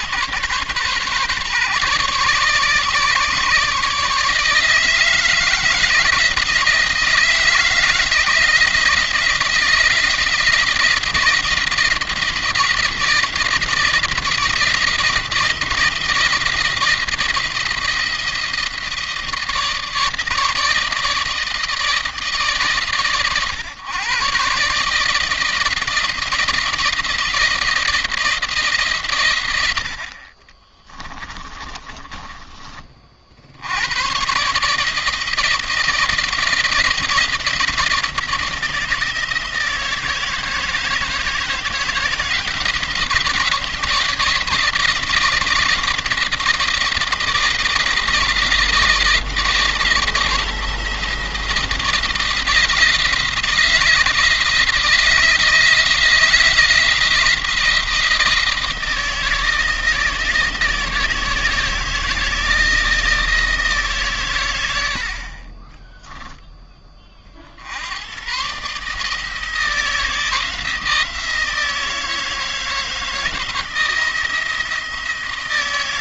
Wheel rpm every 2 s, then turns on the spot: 140, 140, 160, 160, 170, 170, 170, 170, 170, 160, 160, 150, 140, 170, 150, 30, 30, 150, 170, 170, 160, 170, 170, 170, 170, 170, 170, 160, 160, 170, 160, 160, 80, 20, 140, 170, 160, 160.
30-32